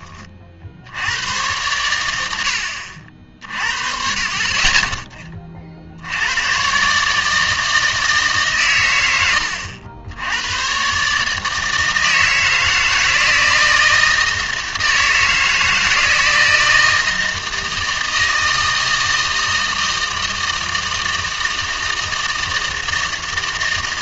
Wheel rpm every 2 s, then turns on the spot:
70, 70, 20, 130, 120, 120, 160, 160, 160, 160, 160, 160.
none